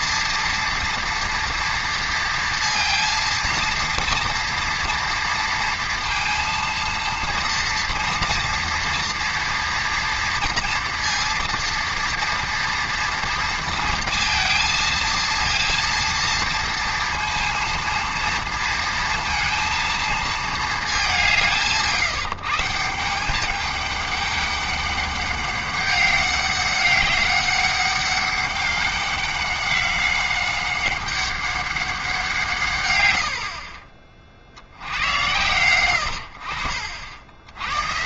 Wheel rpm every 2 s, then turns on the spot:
230, 230, 230, 230, 230, 230, 230, 230, 230, 230, 220, 160, 200, 200, 200, 190, 150, 70, 60.
none